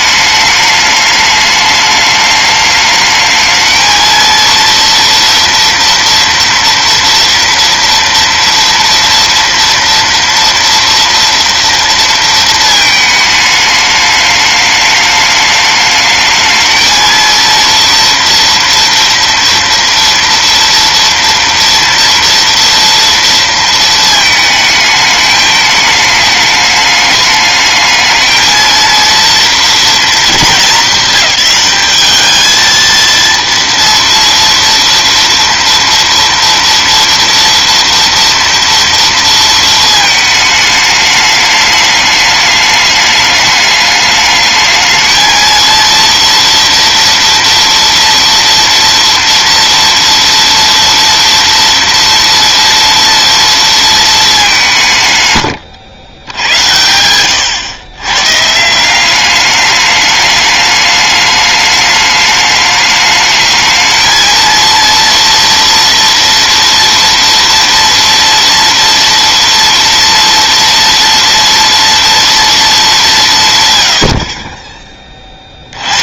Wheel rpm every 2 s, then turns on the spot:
210, 210, 230, 230, 230, 230, 230, 210, 220, 240, 230, 230, 220, 210, 220, 220, 220, 230, 230, 230, 210, 210, 210, 240, 230, 230, 230, 200, 100, 150, 210, 210, 230, 230, 230, 230, 230, 40.
none